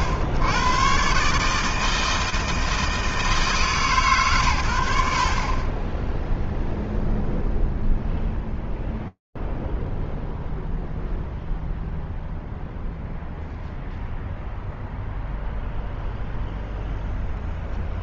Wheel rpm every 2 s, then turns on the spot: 80, 160, 100, 0, 0, 0, 0, 0, 0.
none